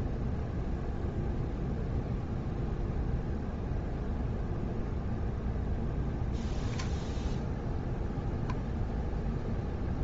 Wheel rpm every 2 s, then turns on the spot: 0, 0, 0, 0, 0.
none